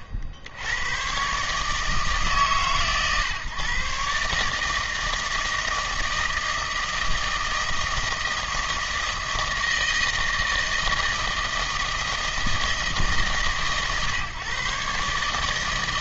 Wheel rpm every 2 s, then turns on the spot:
70, 140, 160, 160, 160, 160, 150, 120.
none